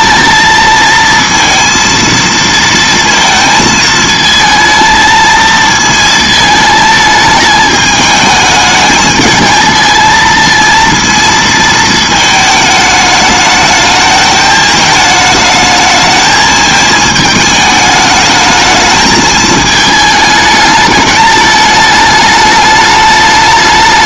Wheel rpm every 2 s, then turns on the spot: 230, 230, 220, 220, 210, 230, 220, 220, 220, 220, 210, 210.
none